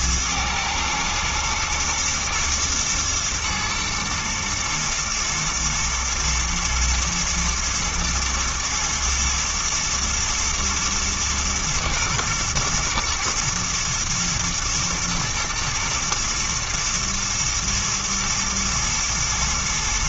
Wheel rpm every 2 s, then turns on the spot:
110, 110, 120, 120, 110, 120, 120, 110, 120, 110.
none